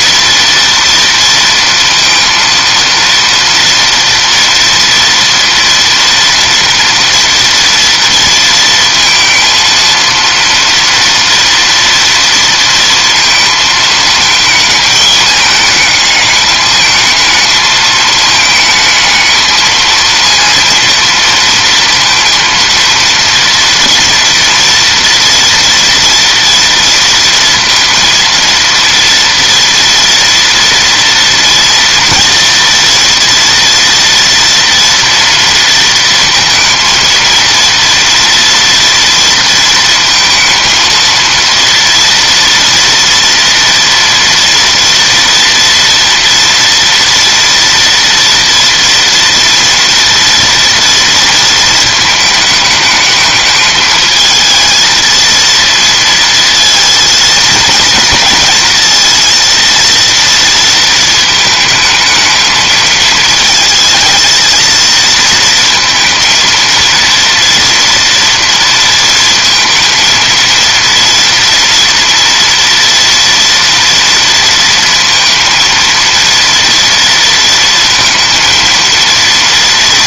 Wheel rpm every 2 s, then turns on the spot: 230, 230, 230, 230, 230, 230, 230, 220, 220, 220, 230, 230, 230, 230, 230, 230, 230, 230, 230, 230, 230, 230, 230, 230, 230, 230, 210, 230, 220, 230, 220, 220, 230, 230, 230, 230, 230, 230, 230, 230.
none